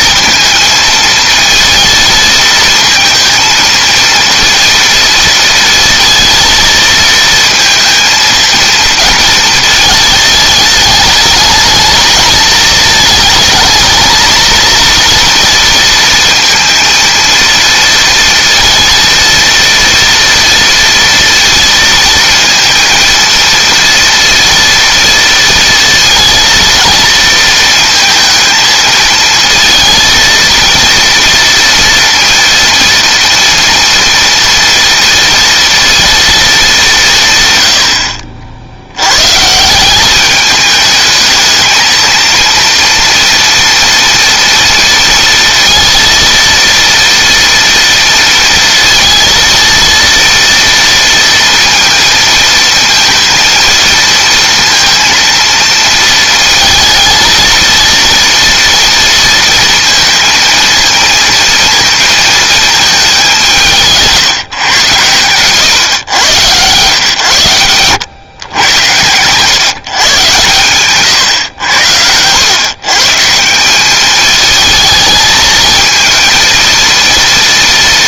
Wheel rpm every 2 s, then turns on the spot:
230, 230, 230, 230, 230, 210, 220, 230, 230, 230, 230, 230, 230, 230, 220, 230, 230, 230, 190, 90, 210, 230, 230, 230, 230, 230, 230, 230, 220, 230, 230, 210, 130, 120, 110, 120, 130, 220, 230.
70-72